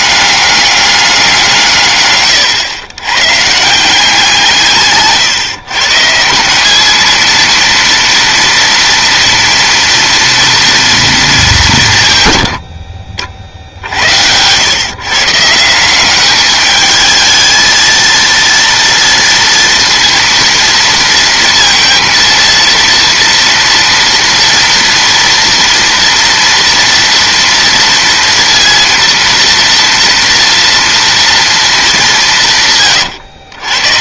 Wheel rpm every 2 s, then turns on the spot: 200, 100, 160, 180, 230, 230, 100, 110, 210, 230, 230, 230, 240, 230, 230, 230, 170.
none